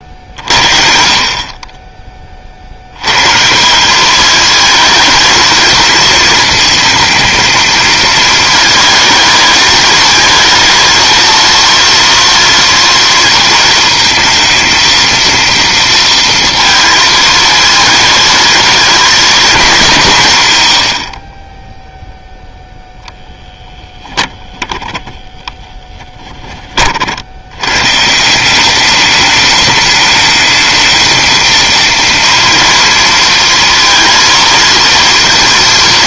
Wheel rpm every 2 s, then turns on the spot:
50, 70, 220, 220, 220, 230, 230, 230, 230, 230, 110, 10, 20, 30, 190, 220, 230, 230.
24-26